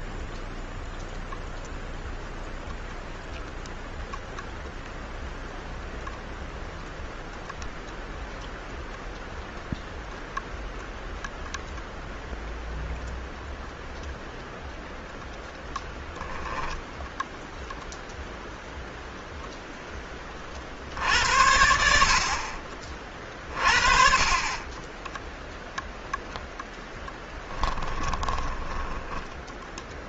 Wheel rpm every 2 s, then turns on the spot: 0, 0, 0, 0, 0, 0, 0, 0, 0, 0, 50, 50, 30, 10, 20.
28-30